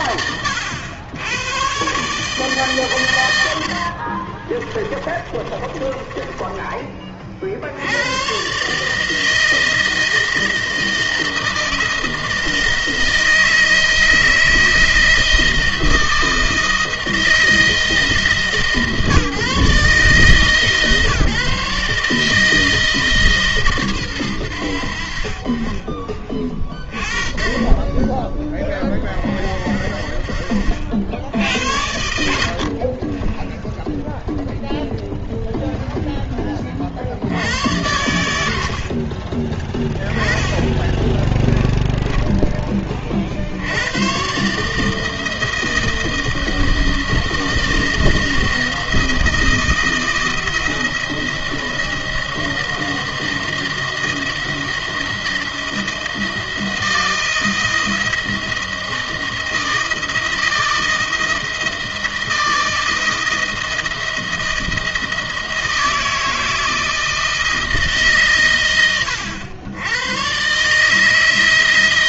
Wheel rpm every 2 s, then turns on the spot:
90, 140, 30, 20, 140, 160, 160, 160, 160, 150, 140, 160, 90, 20, 20, 50, 60, 0, 40, 70, 10, 20, 140, 160, 160, 160, 160, 160, 160, 160, 160, 160, 160, 160, 110, 150.
4-6